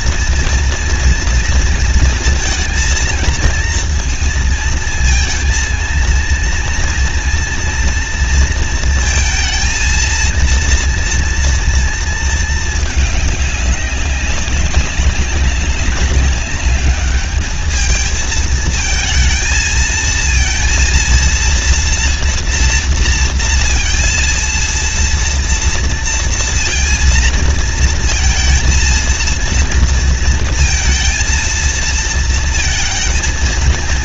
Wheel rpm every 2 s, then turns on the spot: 230, 230, 230, 230, 230, 230, 220, 200, 200, 220, 230, 230, 230, 230, 230, 230, 230.
none